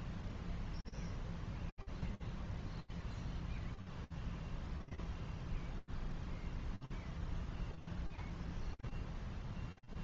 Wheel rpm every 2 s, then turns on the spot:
0, 0, 0, 0, 0.
none